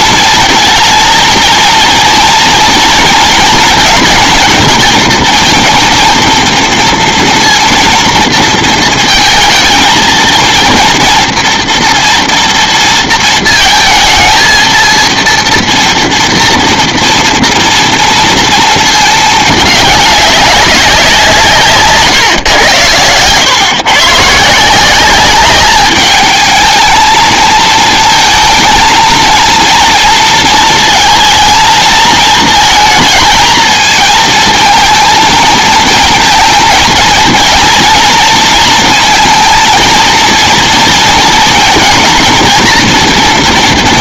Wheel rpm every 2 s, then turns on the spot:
230, 230, 230, 230, 230, 230, 230, 230, 230, 230, 190, 110, 170, 220, 220, 230, 220, 230, 230, 230, 230, 230.
none